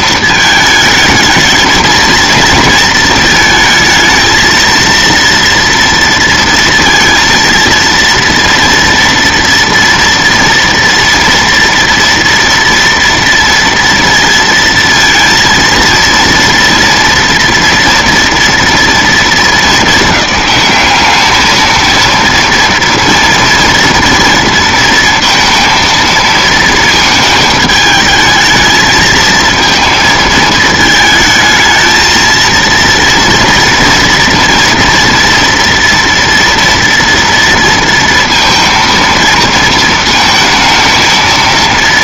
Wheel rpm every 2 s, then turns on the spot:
220, 230, 230, 230, 230, 230, 230, 230, 230, 230, 210, 240, 230, 230, 220, 220, 230, 230, 230, 230, 230.
none